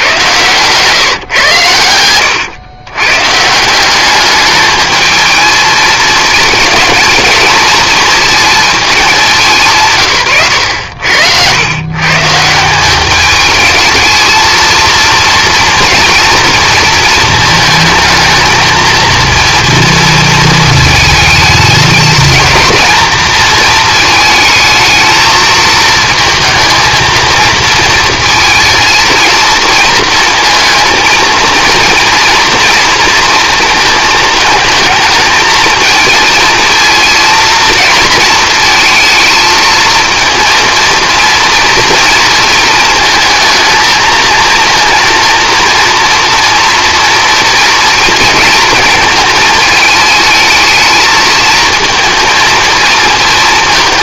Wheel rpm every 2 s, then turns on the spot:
140, 120, 220, 230, 210, 90, 190, 230, 230, 220, 220, 220, 220, 220, 230, 230, 230, 220, 220, 220, 230, 230, 230, 230, 220, 220, 220.
none